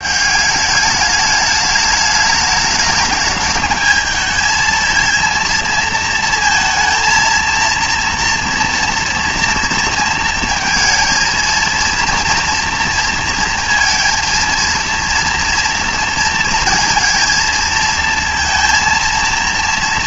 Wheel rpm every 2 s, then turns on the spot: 210, 210, 230, 230, 230, 230, 230, 230, 230, 230.
none